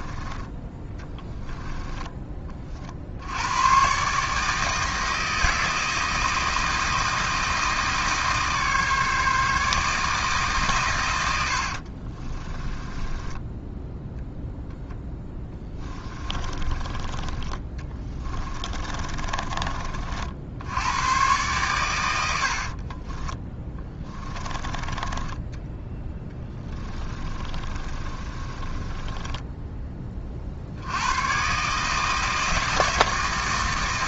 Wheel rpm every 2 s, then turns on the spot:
20, 60, 160, 160, 150, 110, 10, 0, 20, 30, 90, 50, 20, 20, 20, 80, 160.
0-2 12-14 18-20 22-24 26-30